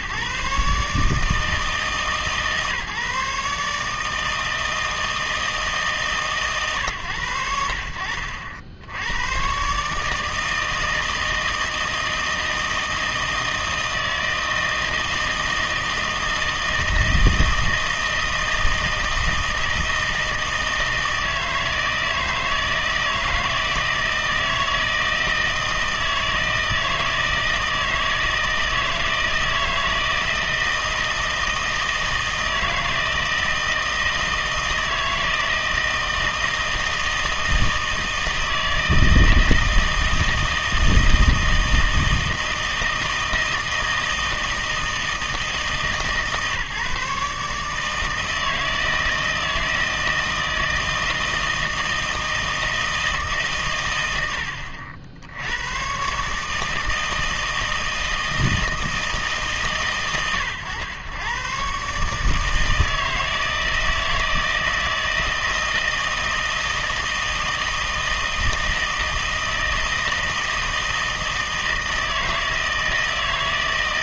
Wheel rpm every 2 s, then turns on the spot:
150, 140, 160, 120, 90, 160, 160, 160, 160, 160, 160, 160, 160, 160, 160, 160, 160, 160, 160, 160, 160, 160, 160, 150, 160, 160, 160, 70, 160, 160, 100, 160, 160, 160, 160, 160, 160.
none